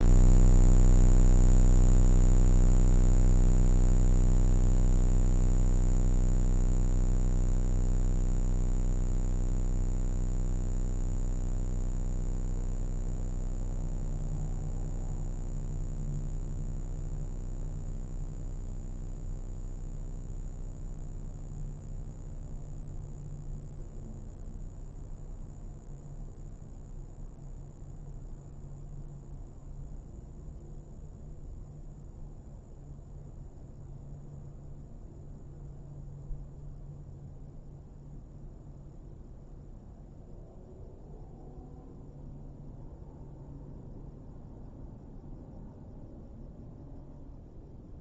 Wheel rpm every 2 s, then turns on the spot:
0, 0, 0, 0, 0, 0, 0, 0, 0, 0, 0, 0, 0, 0, 0, 0, 0, 0, 0, 0, 0, 0, 0, 0.
none